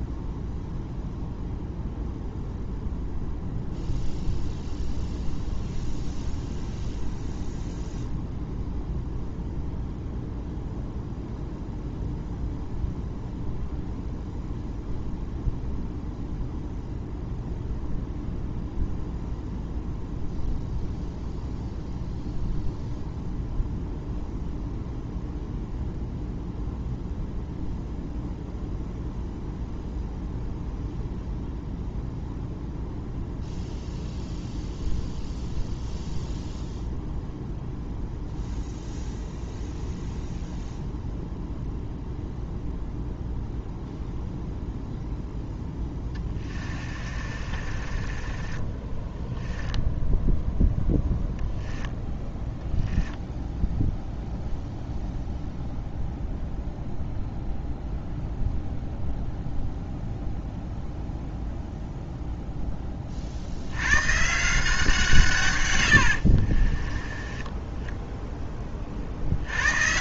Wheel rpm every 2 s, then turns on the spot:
0, 0, 0, 0, 0, 0, 0, 0, 0, 0, 0, 0, 0, 0, 0, 0, 0, 0, 0, 0, 0, 0, 0, 30, 20, 0, 10, 0, 0, 0, 0, 10, 160, 40, 20.
46-50 52-54 66-68